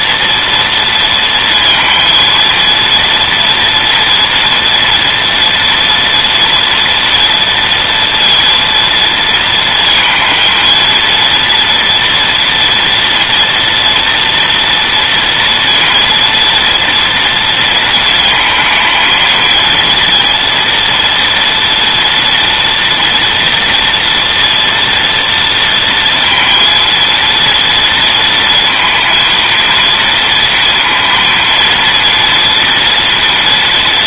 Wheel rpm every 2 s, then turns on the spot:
230, 230, 230, 230, 230, 230, 240, 230, 230, 230, 230, 230, 230, 230, 230, 230, 230.
none